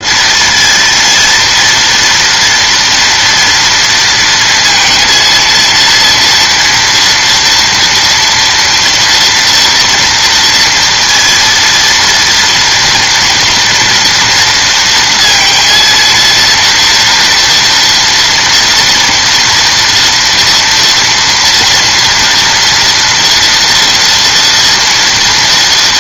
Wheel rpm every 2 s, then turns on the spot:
230, 230, 230, 230, 240, 230, 230, 230, 230, 230, 230, 230, 230.
none